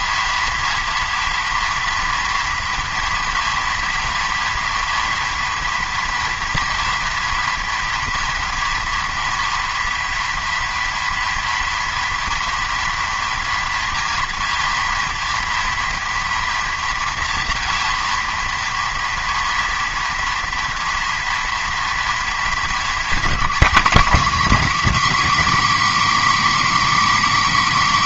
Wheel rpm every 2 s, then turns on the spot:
230, 240, 230, 230, 230, 230, 230, 230, 230, 230, 230, 220, 270, 290.
none